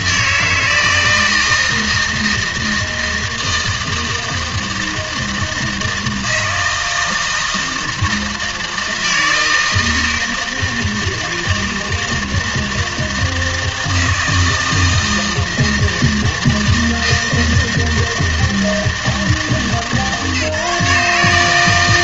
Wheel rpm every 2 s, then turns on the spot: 160, 160, 160, 160, 160, 160, 160, 160, 160, 160, 150.
none